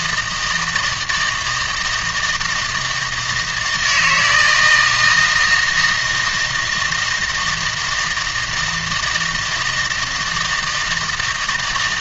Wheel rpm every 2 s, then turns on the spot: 160, 160, 160, 170, 160, 160.
none